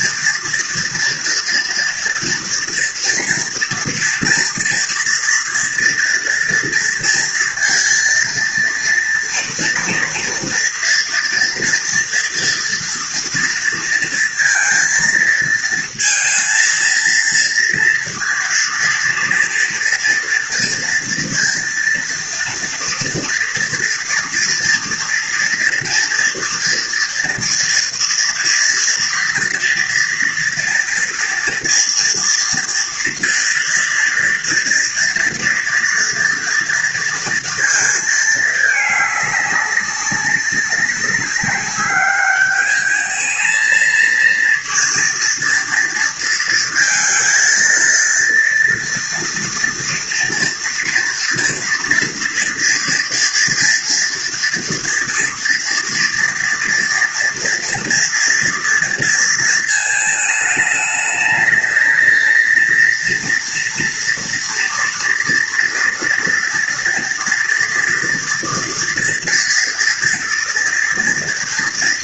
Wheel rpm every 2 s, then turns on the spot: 230, 230, 230, 230, 230, 240, 230, 230, 230, 230, 240, 240, 230, 240, 230, 230, 240, 230, 230, 220, 190, 210, 230, 230, 230, 230, 230, 230, 230, 230, 220, 230, 230, 230, 230, 230.
none